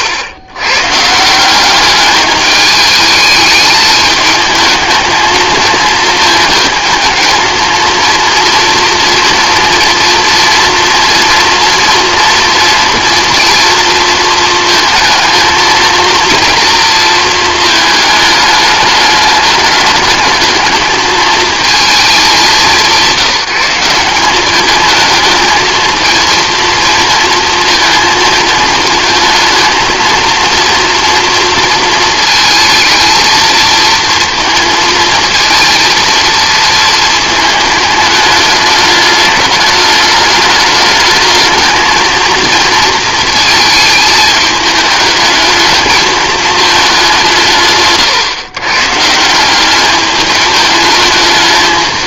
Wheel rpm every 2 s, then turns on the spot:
130, 210, 220, 220, 230, 230, 230, 220, 230, 210, 220, 180, 210, 230, 220, 230, 220, 230, 220, 210, 210, 230, 210, 210, 140, 220.
none